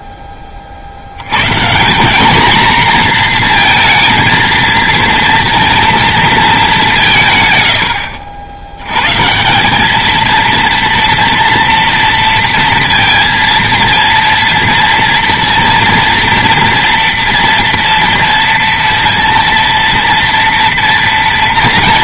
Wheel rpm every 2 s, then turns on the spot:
30, 240, 230, 210, 80, 230, 230, 230, 230, 230, 240.
none